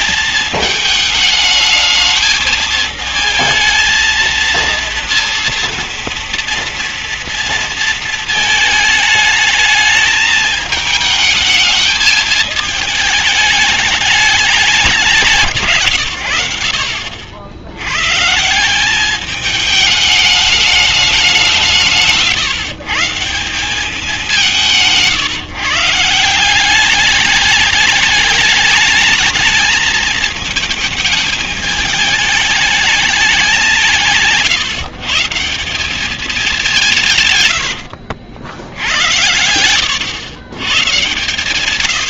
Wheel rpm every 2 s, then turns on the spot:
220, 220, 230, 240, 220, 220, 210, 210, 80, 170, 210, 150, 180, 180, 210, 220, 210, 170, 190, 90, 130.
none